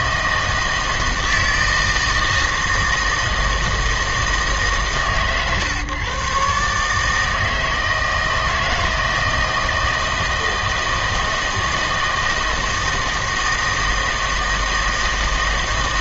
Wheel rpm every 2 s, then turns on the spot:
160, 160, 150, 140, 160, 160, 160, 160.
none